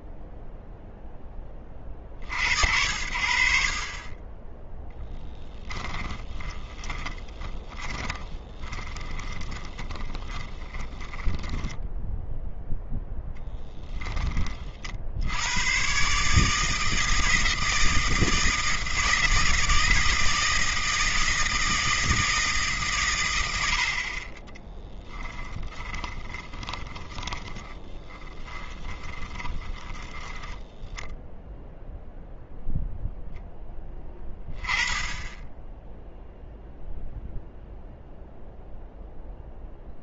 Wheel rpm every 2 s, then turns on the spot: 0, 60, 20, 20, 30, 20, 0, 20, 150, 160, 160, 160, 30, 20, 20, 10, 0, 10, 0, 0.
6-12 24-32